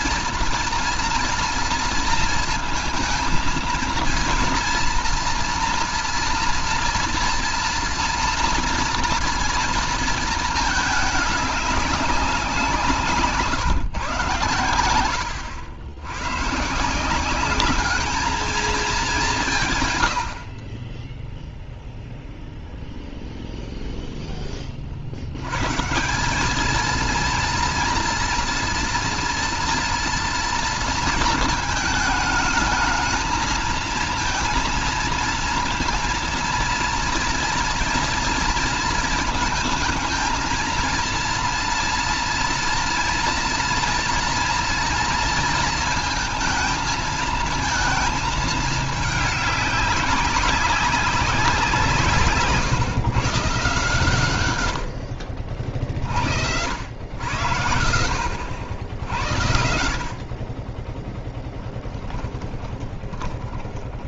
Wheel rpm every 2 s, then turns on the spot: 240, 230, 240, 230, 230, 220, 170, 90, 170, 210, 10, 0, 40, 220, 230, 230, 220, 230, 230, 230, 230, 230, 230, 220, 210, 190, 140, 70, 80, 70, 20, 20.
12-14 62-64